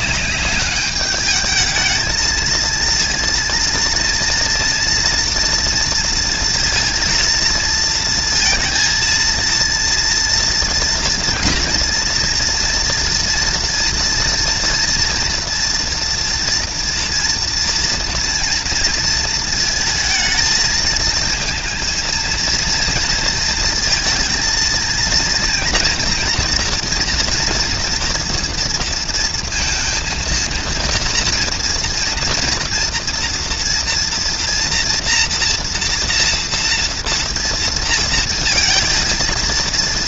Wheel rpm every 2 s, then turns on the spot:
210, 230, 240, 230, 230, 230, 230, 230, 230, 230, 220, 230, 230, 240, 230, 230, 230, 230, 230, 230.
none